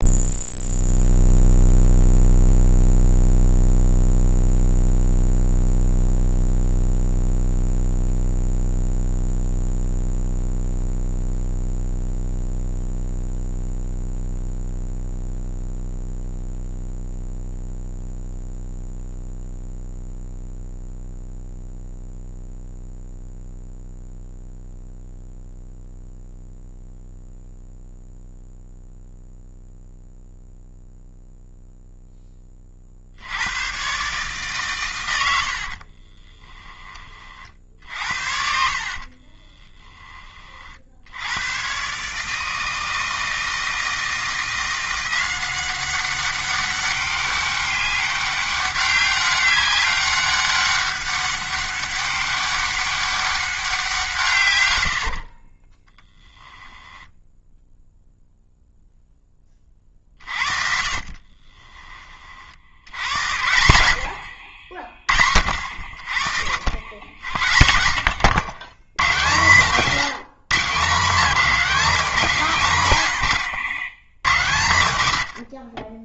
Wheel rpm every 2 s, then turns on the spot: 0, 0, 0, 0, 0, 0, 0, 0, 0, 0, 0, 0, 0, 0, 0, 0, 30, 130, 20, 60, 40, 160, 170, 200, 200, 190, 200, 90, 10, 0, 50, 70, 70, 70, 110, 160, 150, 110.
38-40 54-58 74-76